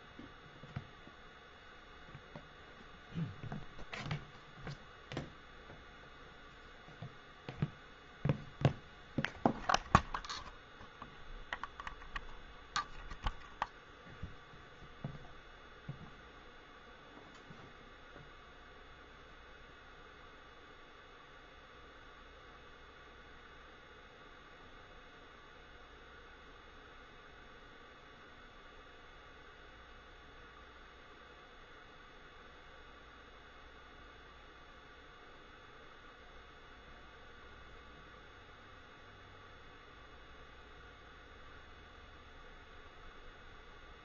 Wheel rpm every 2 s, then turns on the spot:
0, 0, 0, 0, 0, 0, 0, 0, 0, 0, 0, 0, 0, 0, 0, 0, 0, 0, 0, 0, 0, 0.
none